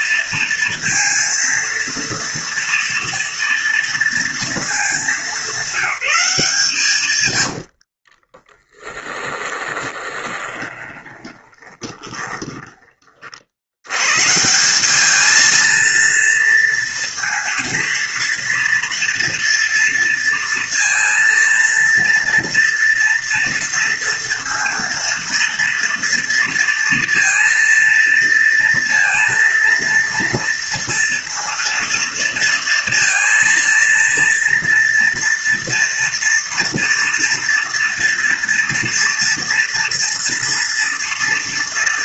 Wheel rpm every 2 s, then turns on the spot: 230, 230, 200, 110, 20, 20, 50, 220, 230, 230, 230, 230, 230, 230, 230, 230, 230, 240, 230, 230, 230.
6-12